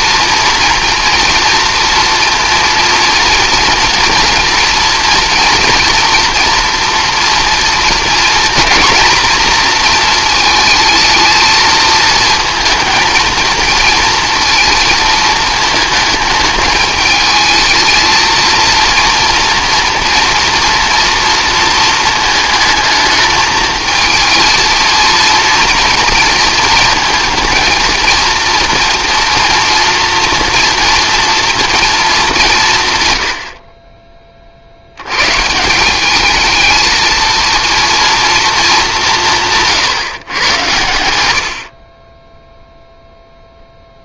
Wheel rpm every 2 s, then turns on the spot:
240, 230, 230, 230, 220, 220, 220, 230, 210, 230, 230, 220, 230, 230, 240, 230, 150, 70, 220, 210, 110, 0.
none